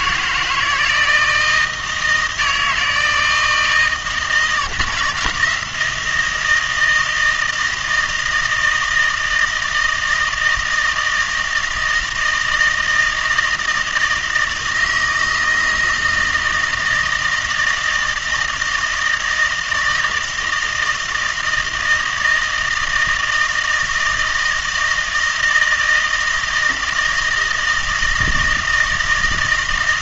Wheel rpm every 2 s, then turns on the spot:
160, 160, 160, 170, 160, 160, 160, 160, 160, 160, 160, 160, 160, 160, 160.
none